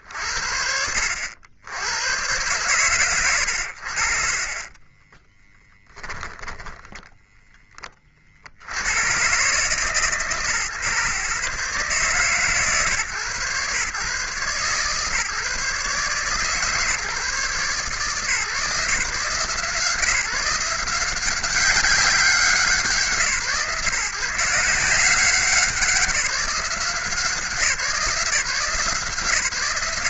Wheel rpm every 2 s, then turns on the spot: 70, 100, 20, 10, 120, 140, 120, 150, 150, 160, 180, 150, 180, 170, 140.
4-6